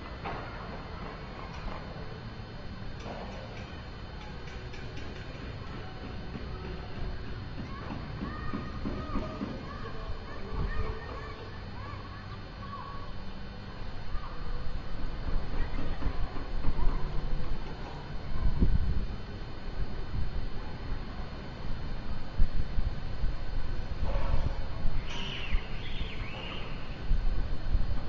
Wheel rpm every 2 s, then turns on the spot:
0, 0, 0, 0, 0, 0, 0, 0, 0, 0, 0, 0, 0, 0.
none